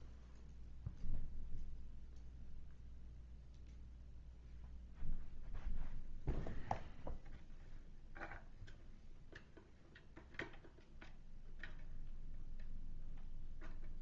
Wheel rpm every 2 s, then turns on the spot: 0, 0, 0, 0, 0, 0, 0.
none